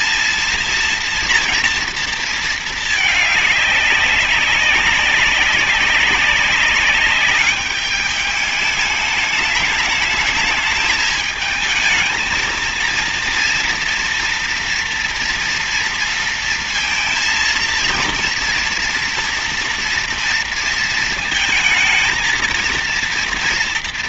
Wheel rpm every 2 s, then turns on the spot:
230, 220, 190, 200, 210, 220, 220, 230, 230, 230, 230, 230.
none